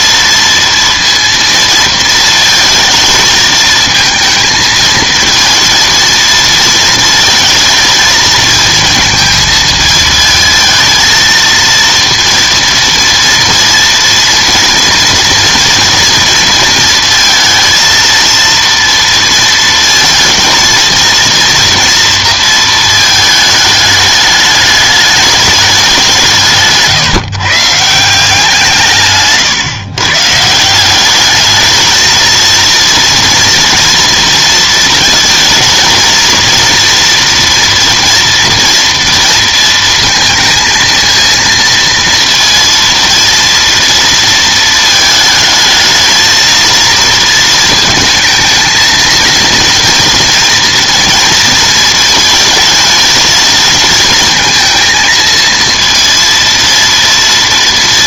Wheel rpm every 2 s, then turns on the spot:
230, 230, 220, 230, 230, 220, 230, 230, 230, 230, 230, 220, 210, 160, 170, 160, 230, 230, 230, 230, 230, 230, 220, 230, 220, 230, 230, 230, 230.
none